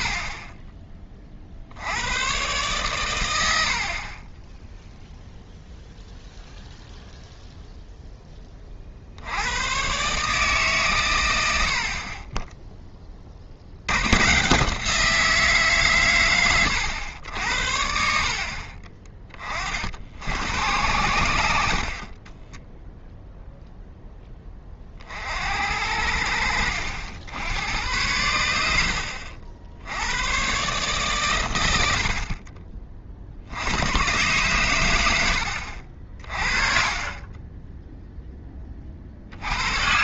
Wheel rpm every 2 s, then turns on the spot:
20, 120, 10, 0, 30, 140, 10, 160, 100, 50, 90, 10, 20, 70, 80, 130, 40, 100, 30, 20.
18-20 22-24